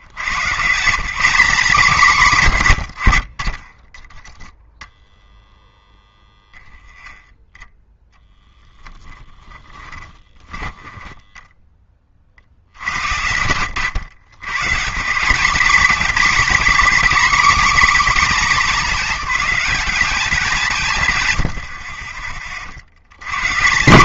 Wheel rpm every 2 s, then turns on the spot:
170, 100, 0, 10, 10, 20, 70, 170, 270, 230, 170, 80.
10-12